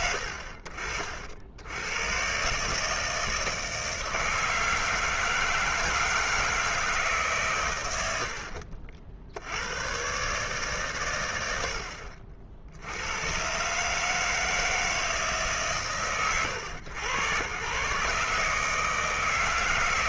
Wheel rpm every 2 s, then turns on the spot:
50, 150, 160, 160, 70, 140, 80, 160, 120, 160.
none